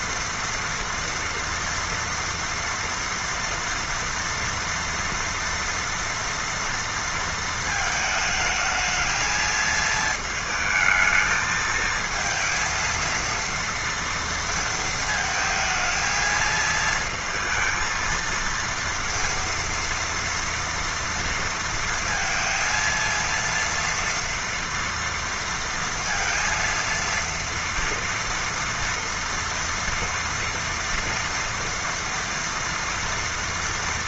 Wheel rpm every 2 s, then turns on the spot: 230, 230, 230, 230, 220, 220, 230, 230, 220, 230, 230, 230, 230, 230, 230, 240, 230.
none